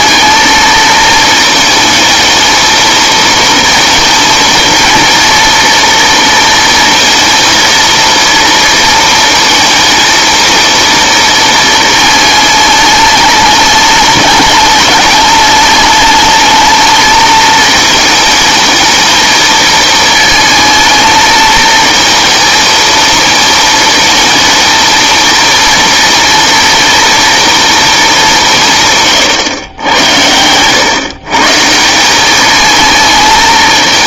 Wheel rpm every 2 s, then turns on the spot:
220, 220, 230, 230, 230, 230, 220, 210, 210, 220, 220, 220, 220, 230, 160, 110, 210.
none